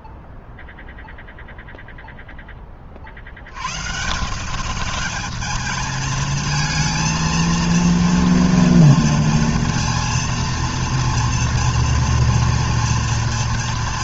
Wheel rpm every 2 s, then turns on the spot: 0, 20, 180, 220, 230, 230, 230.
none